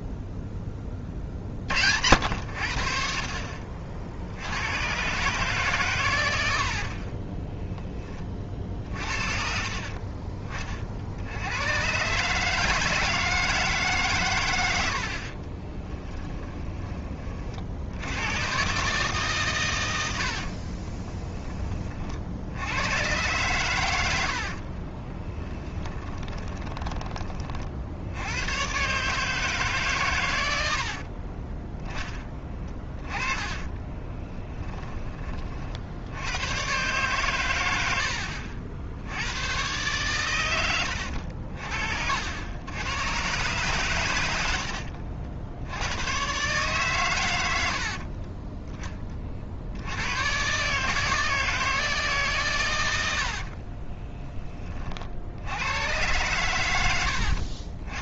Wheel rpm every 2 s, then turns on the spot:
20, 60, 120, 50, 40, 50, 160, 80, 20, 150, 20, 100, 30, 20, 140, 70, 30, 20, 120, 80, 90, 110, 70, 130, 30, 150, 80, 50, 90.
6-8 20-22 24-26 30-34 40-42